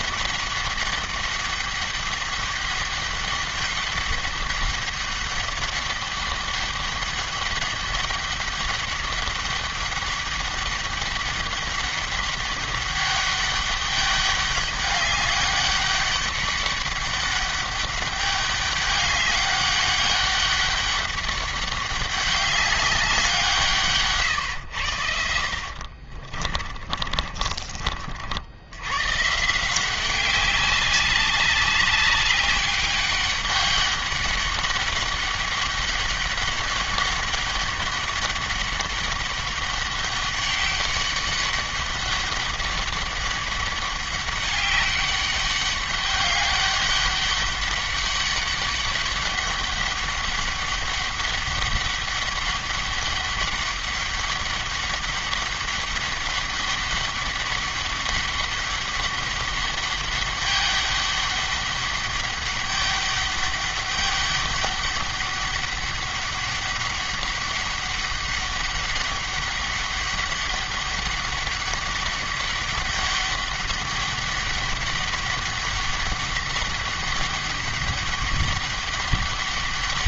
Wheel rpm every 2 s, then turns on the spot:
200, 200, 200, 200, 200, 200, 200, 200, 200, 200, 200, 190, 90, 40, 100, 200, 200, 190, 200, 200, 200, 200, 200, 200, 200, 200, 200, 200, 200, 200, 200, 200, 200, 200, 200, 200, 200, 200, 200, 200.
26-28